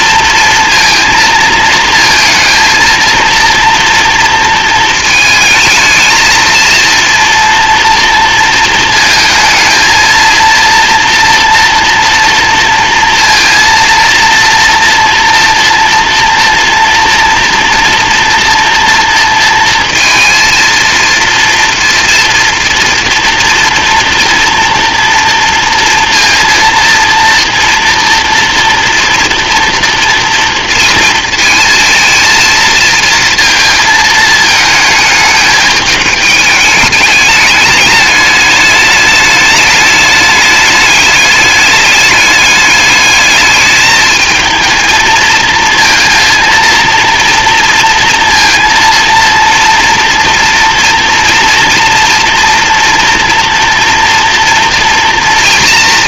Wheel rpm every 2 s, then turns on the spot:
230, 230, 230, 230, 220, 230, 230, 230, 240, 230, 230, 230, 230, 230, 230, 230, 230, 220, 210, 210, 210, 210, 220, 230, 230, 230, 230, 230.
none